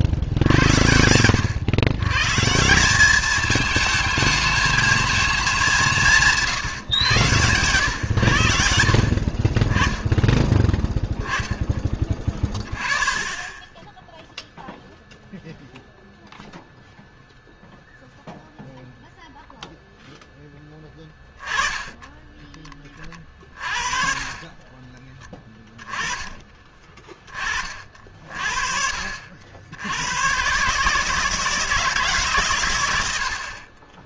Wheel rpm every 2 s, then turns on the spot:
70, 160, 220, 150, 70, 10, 20, 0, 0, 0, 10, 20, 20, 20, 50, 140, 120.
10-12